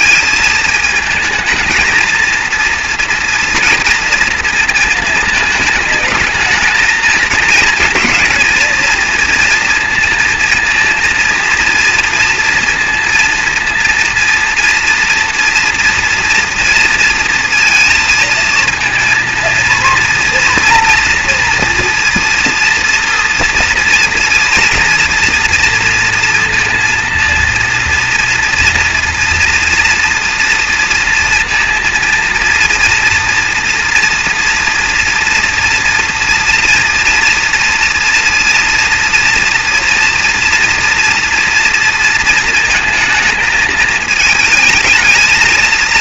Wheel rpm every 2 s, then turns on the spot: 220, 230, 220, 210, 220, 230, 230, 230, 230, 220, 230, 230, 230, 230, 230, 230, 230, 230, 230, 240, 230, 230, 220.
none